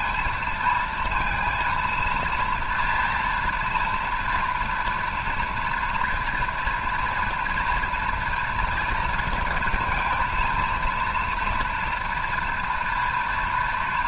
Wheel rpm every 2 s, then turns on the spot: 230, 230, 240, 230, 230, 230, 230.
none